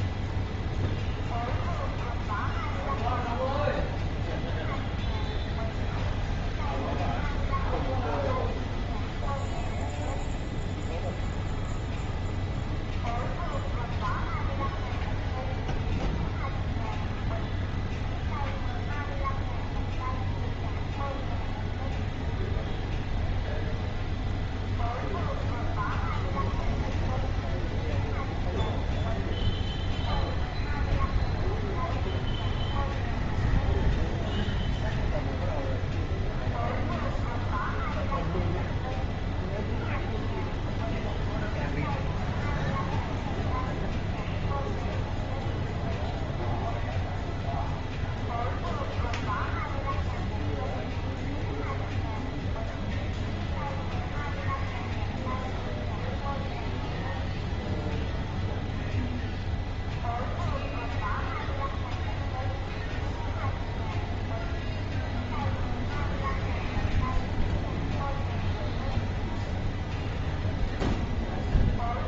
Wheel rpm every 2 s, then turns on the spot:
0, 0, 0, 0, 0, 0, 0, 0, 0, 0, 0, 0, 0, 0, 0, 0, 0, 0, 0, 0, 0, 0, 0, 0, 0, 0, 0, 0, 0, 0, 0, 0, 0, 0, 0, 0.
none